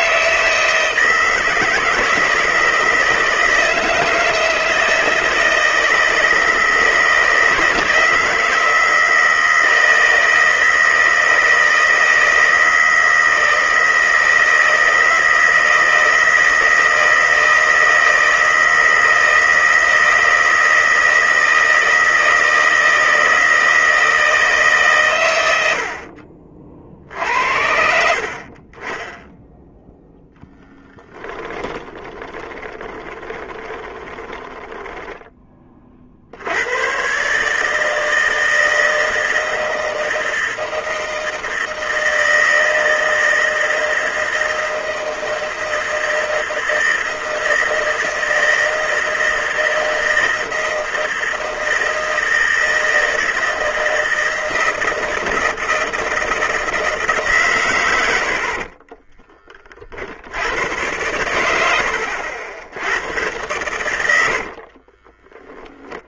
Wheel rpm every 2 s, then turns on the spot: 160, 160, 160, 160, 160, 160, 160, 160, 160, 160, 160, 160, 150, 60, 20, 10, 20, 10, 90, 160, 160, 160, 160, 160, 160, 160, 160, 170, 160, 40, 100, 90, 40.
32-36 58-60 64-66